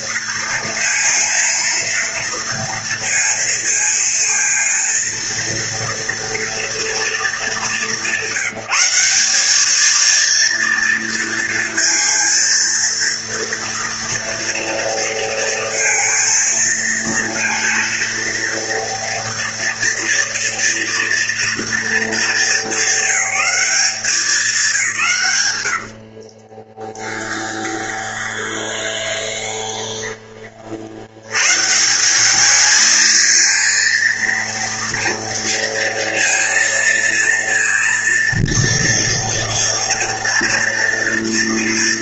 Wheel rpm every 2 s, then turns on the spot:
230, 230, 230, 220, 190, 230, 230, 230, 230, 230, 240, 220, 150, 10, 20, 100, 220, 230, 230, 230, 230.
26-30